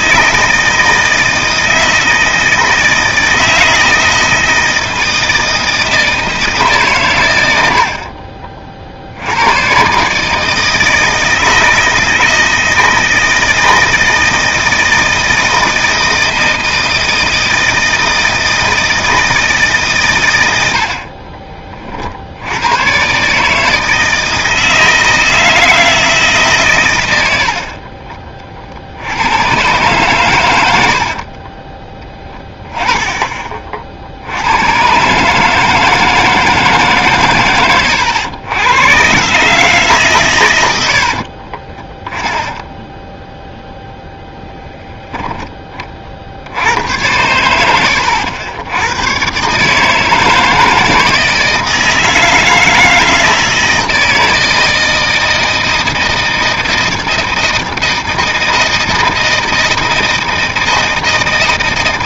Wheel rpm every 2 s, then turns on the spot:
160, 160, 160, 80, 100, 160, 160, 160, 160, 160, 30, 140, 160, 90, 80, 50, 20, 130, 150, 110, 80, 10, 10, 70, 100, 160, 160, 160, 160, 160, 160.
30-32 40-44